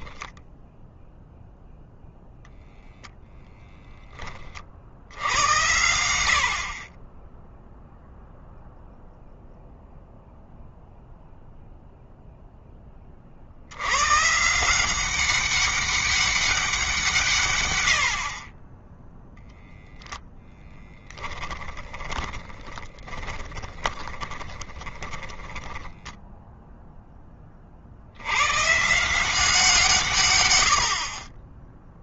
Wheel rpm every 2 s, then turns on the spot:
0, 0, 70, 30, 0, 0, 20, 180, 160, 10, 10, 20, 20, 10, 160, 50.
20-26